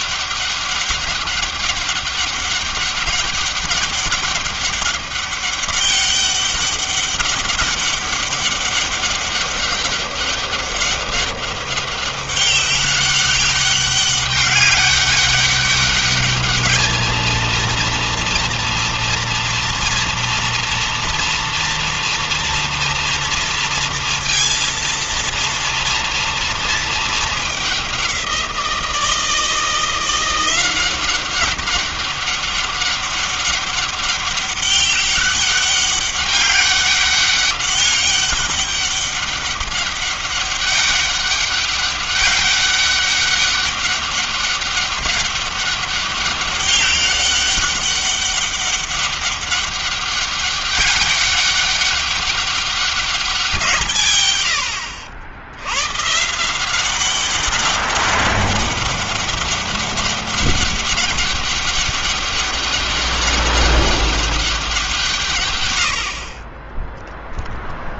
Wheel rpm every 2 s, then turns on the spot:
200, 200, 200, 200, 200, 200, 200, 200, 210, 230, 230, 230, 230, 230, 180, 170, 200, 200, 200, 200, 200, 200, 200, 200, 200, 200, 200, 110, 150, 200, 200, 200, 200, 40.
none